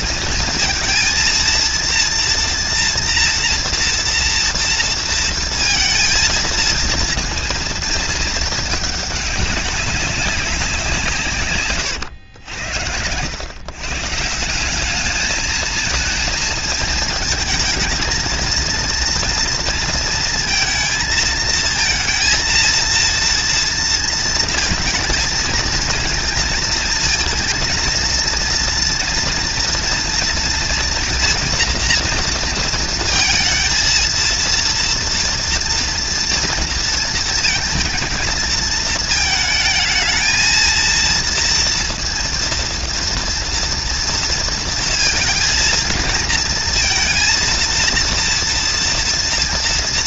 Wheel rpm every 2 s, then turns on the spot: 230, 240, 230, 230, 210, 160, 90, 210, 220, 230, 220, 230, 220, 220, 230, 230, 230, 230, 230, 230, 230, 230, 230, 230, 230.
none